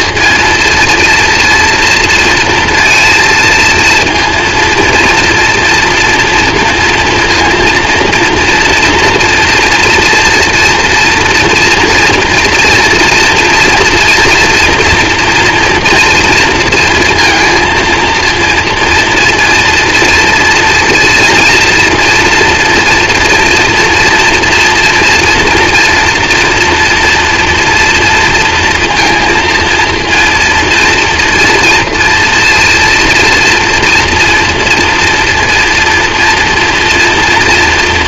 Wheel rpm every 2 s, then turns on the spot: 230, 230, 230, 230, 240, 230, 230, 230, 230, 230, 230, 230, 230, 240, 230, 230, 240, 230, 230.
none